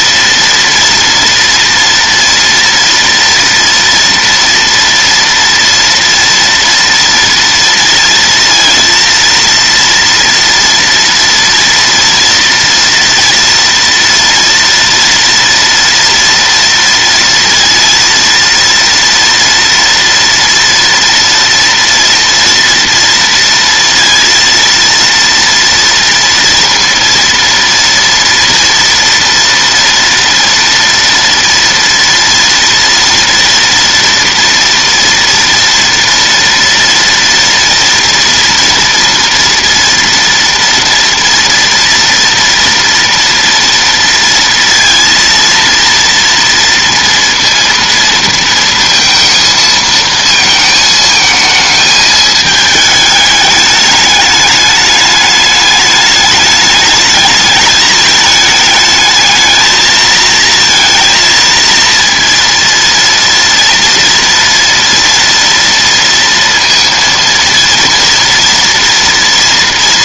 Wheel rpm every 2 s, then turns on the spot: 230, 230, 230, 230, 230, 230, 230, 230, 230, 230, 230, 230, 230, 240, 230, 230, 230, 240, 230, 230, 230, 230, 230, 230, 230, 220, 220, 210, 210, 220, 230, 230, 230, 230, 230.
none